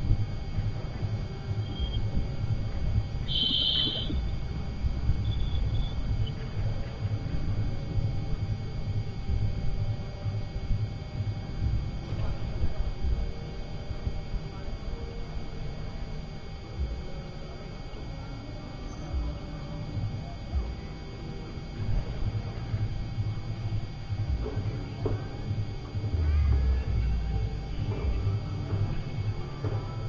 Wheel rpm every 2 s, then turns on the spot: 0, 0, 0, 0, 0, 0, 0, 0, 0, 0, 0, 0, 0, 0, 0.
none